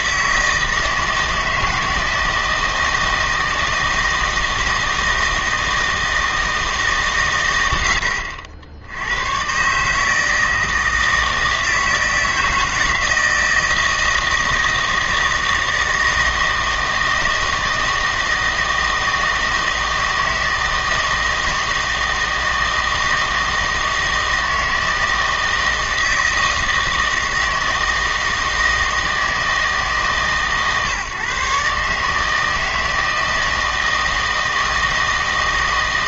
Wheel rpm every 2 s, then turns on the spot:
160, 160, 160, 160, 70, 160, 160, 160, 160, 160, 160, 160, 160, 160, 160, 140, 160, 160.
none